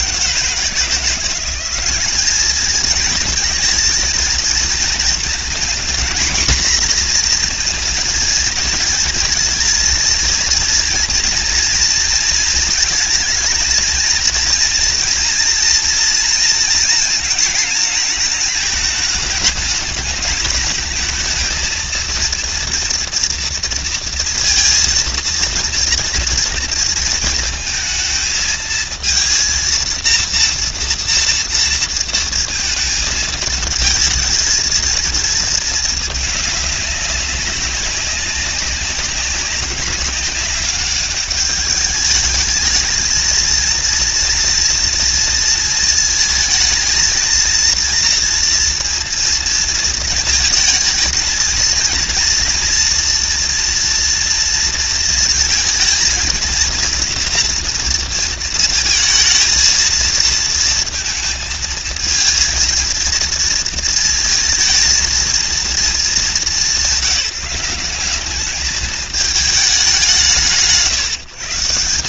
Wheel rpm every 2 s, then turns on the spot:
170, 230, 230, 240, 230, 230, 230, 230, 230, 220, 230, 230, 230, 230, 230, 230, 220, 230, 200, 190, 210, 230, 230, 230, 230, 230, 230, 230, 230, 230, 230, 230, 220, 190, 220, 150.
none